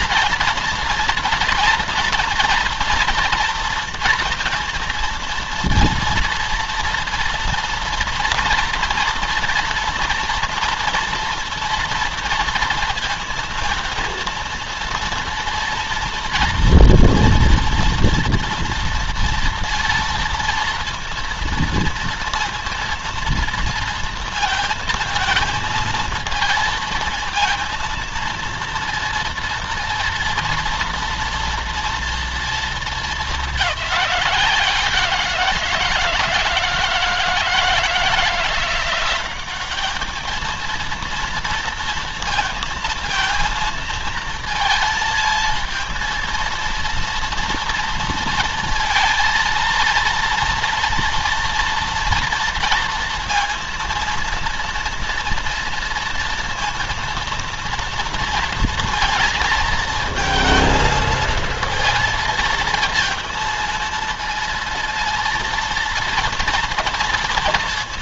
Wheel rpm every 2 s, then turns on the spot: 230, 230, 230, 230, 230, 240, 230, 230, 230, 230, 230, 230, 220, 230, 230, 230, 220, 180, 160, 180, 230, 230, 220, 230, 230, 230, 230, 230, 230, 230, 220, 230, 230, 220.
none